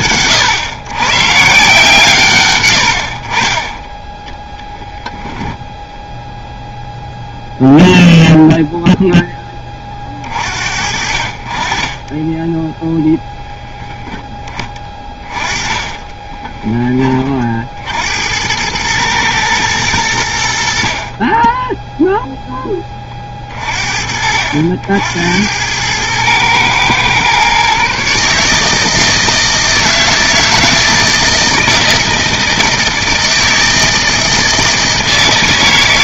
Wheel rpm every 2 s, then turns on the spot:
130, 30, 0, 0, 0, 50, 0, 20, 20, 90, 60, 10, 70, 110, 150, 160, 160, 160.
14-18